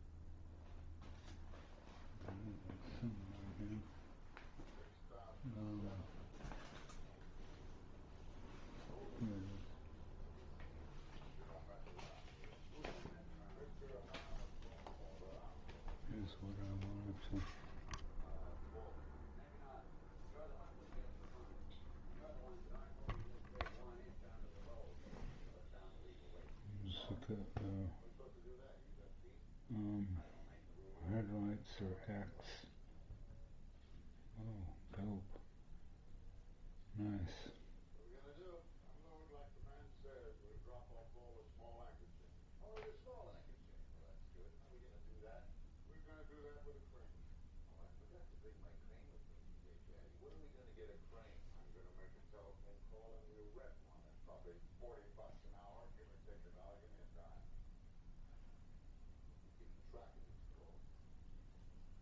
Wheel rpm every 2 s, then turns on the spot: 0, 0, 0, 0, 0, 0, 0, 0, 0, 0, 0, 0, 0, 0, 0, 0, 0, 0, 0, 0, 0, 0, 0, 0, 0, 0, 0, 0, 0, 0, 0.
none